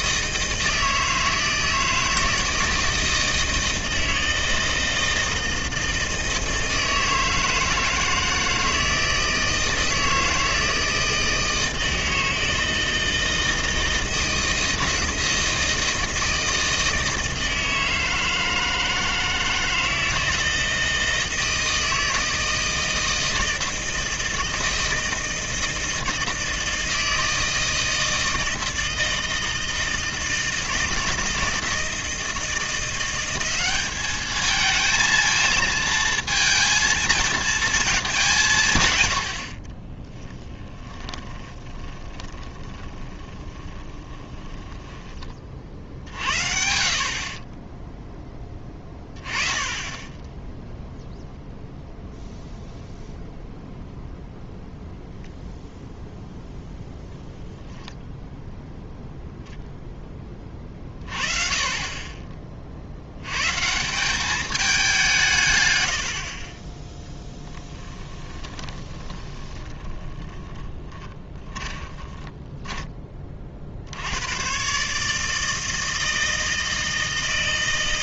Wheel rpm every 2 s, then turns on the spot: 160, 160, 160, 160, 160, 160, 160, 160, 160, 160, 160, 160, 160, 160, 160, 160, 170, 220, 230, 140, 10, 20, 10, 50, 10, 0, 0, 0, 0, 0, 30, 50, 200, 20, 20, 10, 10, 130, 160.
40-46 68-74